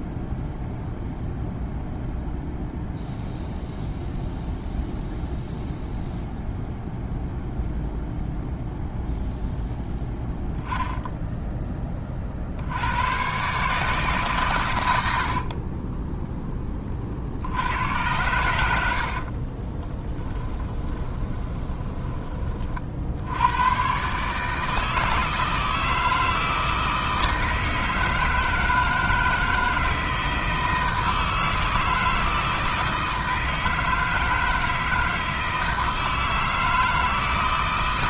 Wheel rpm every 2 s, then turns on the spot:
0, 0, 0, 0, 0, 10, 90, 100, 30, 80, 20, 40, 160, 160, 160, 160, 160, 160, 160.
18-22